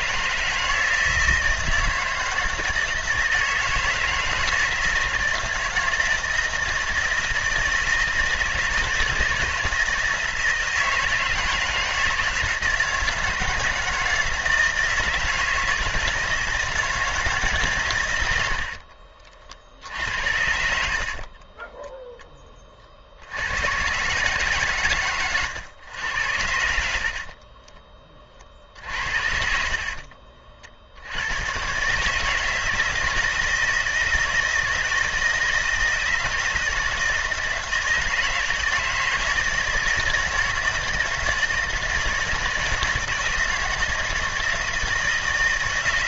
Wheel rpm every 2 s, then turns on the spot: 160, 160, 160, 160, 160, 160, 160, 160, 160, 70, 70, 30, 130, 70, 50, 60, 160, 160, 160, 160, 160, 160, 160.
18-20 28-30